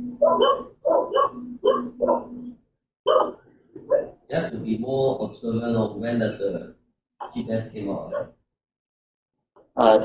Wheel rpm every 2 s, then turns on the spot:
0, 0, 0, 0, 0.
none